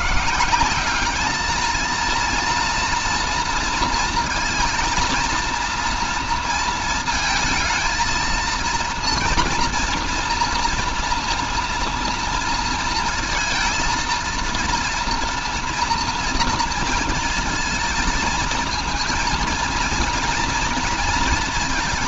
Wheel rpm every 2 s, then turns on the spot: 190, 230, 230, 230, 230, 230, 230, 230, 230, 230, 240.
none